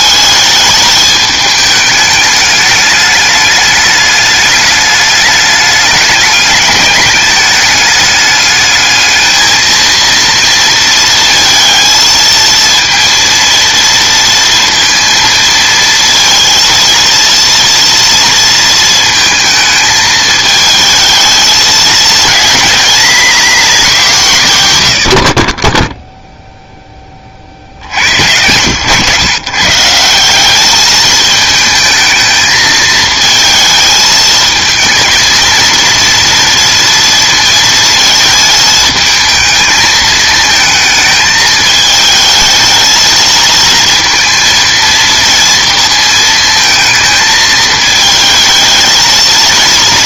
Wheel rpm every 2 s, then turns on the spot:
220, 210, 210, 210, 220, 230, 230, 230, 230, 230, 220, 230, 120, 0, 100, 210, 220, 220, 230, 220, 220, 220, 230, 220, 220.
none